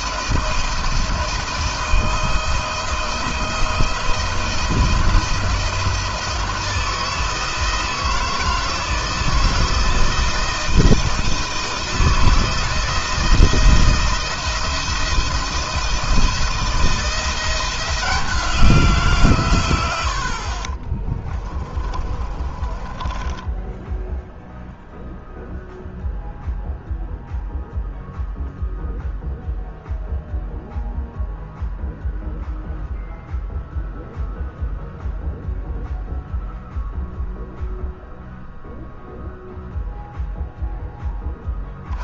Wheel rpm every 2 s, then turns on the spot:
160, 160, 170, 160, 160, 160, 170, 170, 170, 160, 50, 20, 0, 0, 0, 0, 0, 0, 0, 0, 10.
20-24